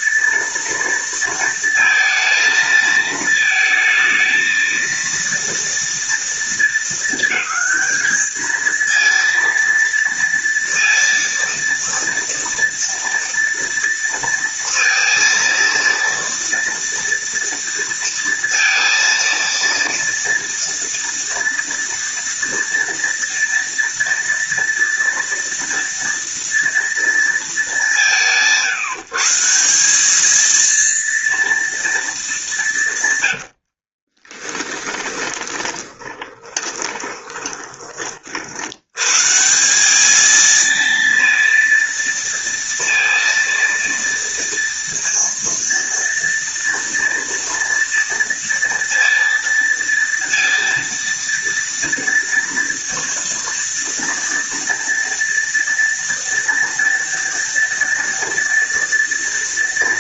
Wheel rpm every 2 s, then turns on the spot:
230, 220, 230, 220, 230, 230, 230, 230, 230, 230, 230, 230, 230, 230, 150, 230, 150, 10, 20, 90, 230, 230, 230, 230, 230, 230, 230, 230, 230, 230.
34-38